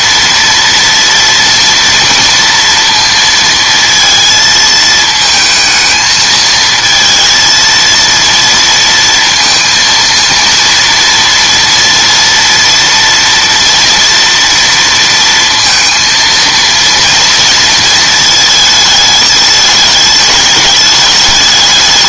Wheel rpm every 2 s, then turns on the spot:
230, 230, 220, 230, 230, 230, 230, 230, 230, 220, 210.
none